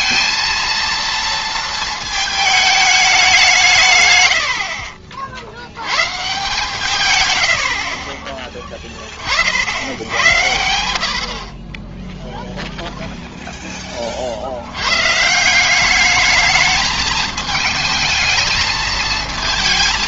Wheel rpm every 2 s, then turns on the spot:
230, 220, 70, 150, 20, 80, 0, 80, 220, 220.
none